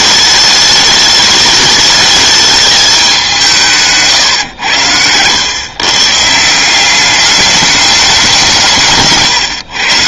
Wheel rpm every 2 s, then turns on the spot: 210, 210, 100, 190, 150.
none